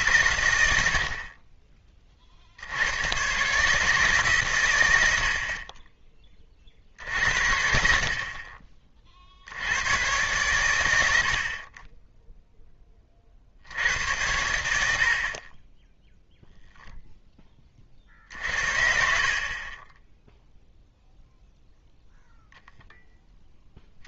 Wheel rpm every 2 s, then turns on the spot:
70, 70, 120, 50, 40, 110, 10, 80, 0, 50, 0, 0.
none